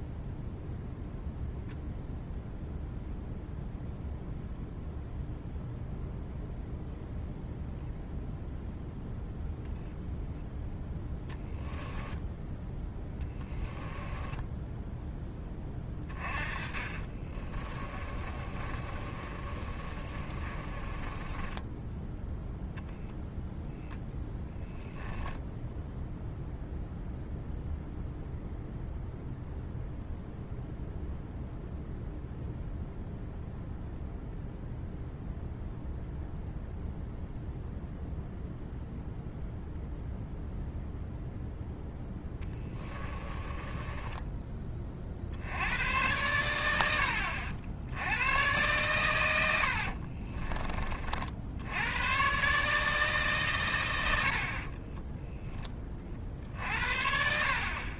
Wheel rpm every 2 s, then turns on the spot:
0, 0, 0, 0, 0, 0, 10, 10, 30, 30, 30, 10, 0, 0, 0, 0, 0, 0, 0, 0, 0, 20, 30, 100, 120, 30, 150, 30, 50.
12-22 42-44 54-58